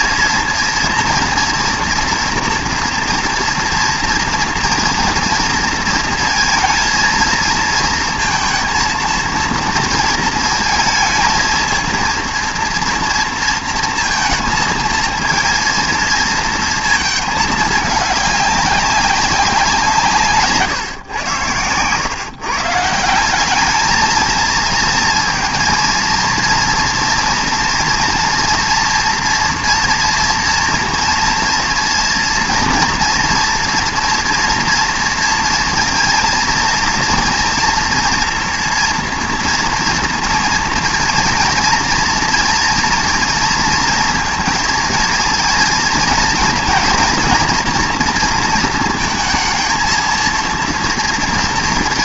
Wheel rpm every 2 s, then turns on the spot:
230, 230, 230, 230, 230, 220, 230, 230, 220, 200, 140, 150, 220, 230, 240, 230, 230, 230, 230, 230, 230, 230, 230, 230, 230, 230.
none